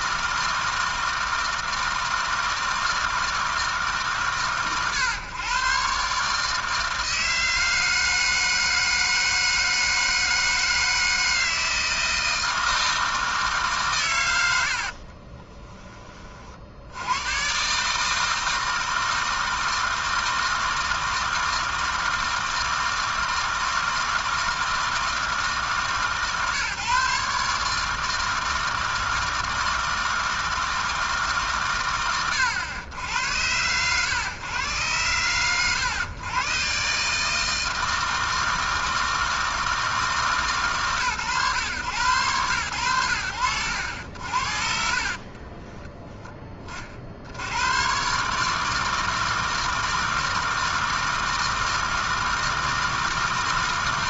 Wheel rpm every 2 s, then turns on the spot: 160, 160, 110, 150, 160, 160, 160, 60, 50, 160, 160, 160, 160, 150, 160, 160, 80, 110, 130, 160, 140, 110, 50, 30, 150, 160, 160.
14-16 44-46